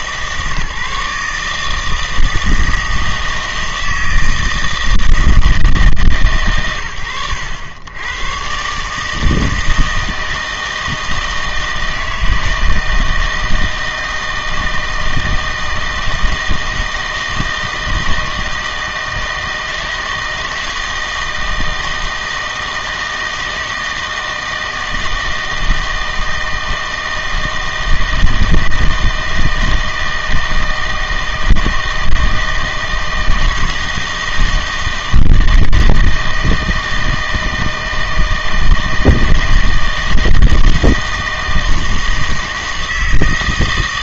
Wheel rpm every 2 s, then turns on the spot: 150, 160, 160, 110, 130, 160, 160, 160, 160, 160, 160, 160, 160, 160, 160, 160, 160, 160, 160, 160, 160, 160.
none